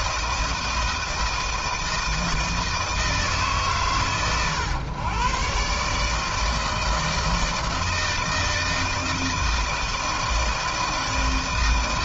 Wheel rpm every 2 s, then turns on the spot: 160, 160, 120, 160, 160, 160.
none